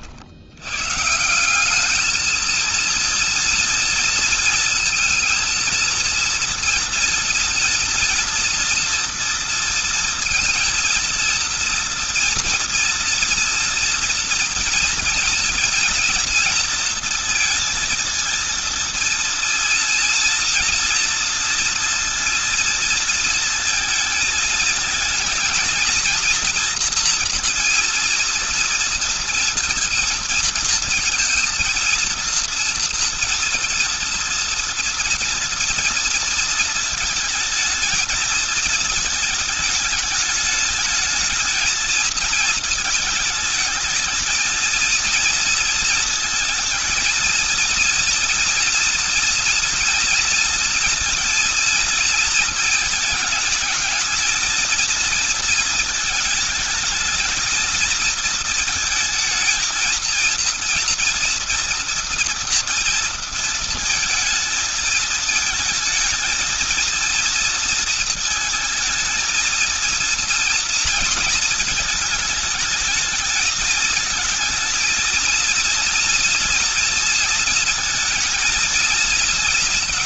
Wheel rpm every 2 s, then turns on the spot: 130, 230, 230, 230, 230, 230, 230, 230, 230, 230, 230, 230, 230, 230, 230, 230, 230, 230, 230, 220, 220, 220, 230, 230, 240, 230, 220, 230, 220, 230, 230, 230, 220, 230, 220, 220, 220, 230, 230, 230.
none